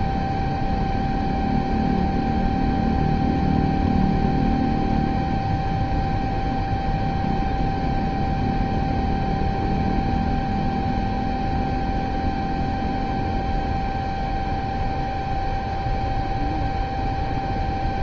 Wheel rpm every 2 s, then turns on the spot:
0, 0, 0, 0, 0, 0, 0, 0, 0.
none